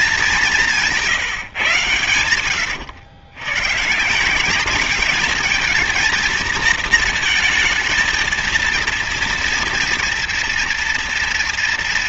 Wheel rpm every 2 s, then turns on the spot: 180, 100, 190, 230, 230, 230.
none